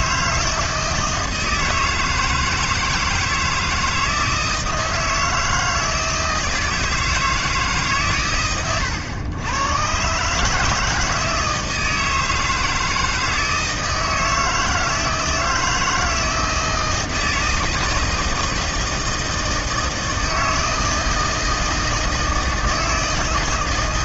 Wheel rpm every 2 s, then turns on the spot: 160, 160, 160, 160, 110, 150, 160, 160, 160, 160, 160, 160.
none